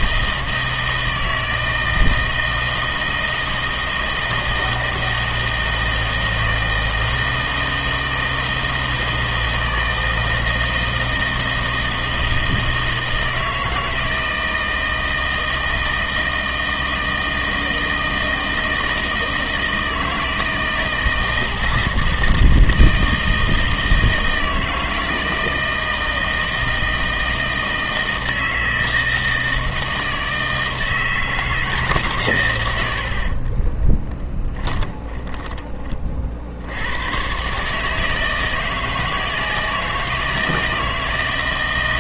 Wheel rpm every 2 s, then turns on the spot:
160, 160, 160, 160, 160, 160, 160, 160, 160, 160, 160, 160, 160, 160, 160, 160, 90, 20, 90, 160, 160.
32-36